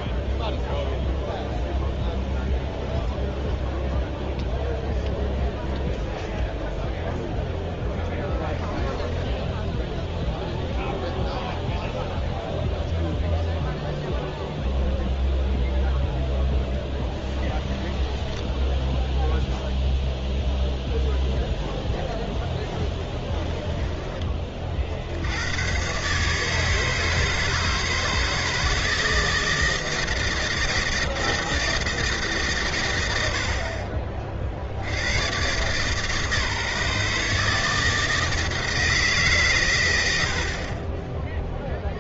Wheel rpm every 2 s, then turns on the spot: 0, 0, 0, 0, 10, 0, 0, 0, 10, 10, 0, 10, 40, 160, 160, 160, 130, 60, 160, 160, 40.
8-10 16-20 22-24